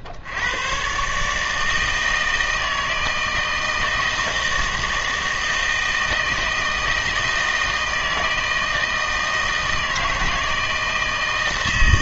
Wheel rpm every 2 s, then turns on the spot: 110, 160, 160, 160, 160, 160.
none